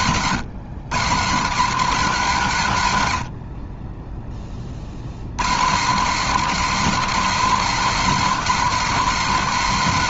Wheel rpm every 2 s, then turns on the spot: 170, 100, 90, 220, 220.
2-4